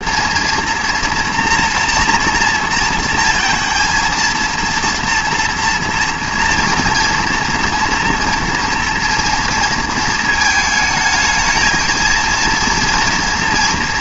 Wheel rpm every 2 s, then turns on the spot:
230, 230, 230, 230, 230, 220, 230.
none